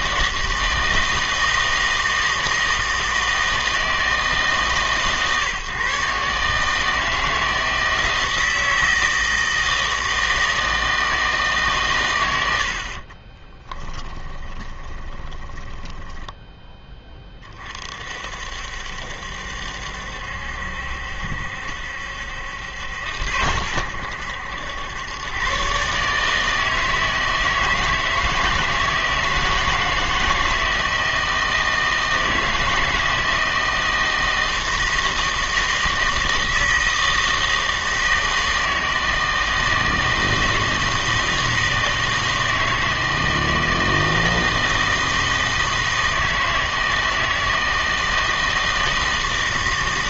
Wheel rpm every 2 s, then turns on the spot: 160, 160, 150, 150, 170, 160, 70, 20, 10, 60, 70, 80, 90, 160, 160, 160, 160, 160, 160, 160, 160, 160, 160, 160, 160.
14-16